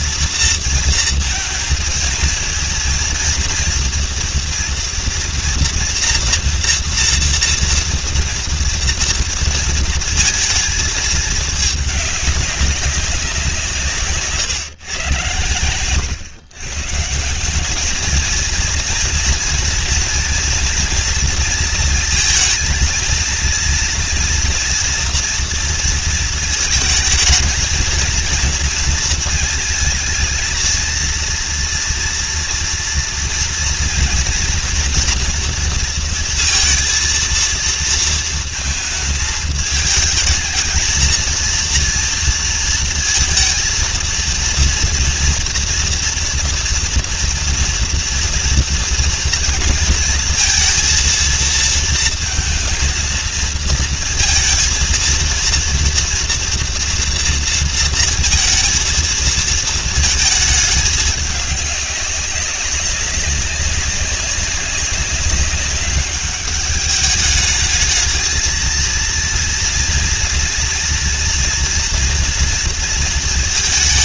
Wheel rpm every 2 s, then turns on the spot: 230, 220, 230, 230, 230, 220, 200, 140, 150, 230, 230, 230, 230, 220, 230, 230, 230, 240, 230, 220, 230, 230, 230, 230, 230, 230, 230, 230, 240, 230, 210, 200, 190, 210, 220, 230, 230.
none